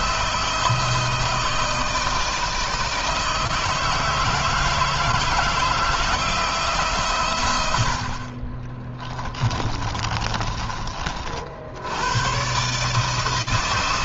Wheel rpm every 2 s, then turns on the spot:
160, 160, 160, 140, 30, 50, 150.
8-10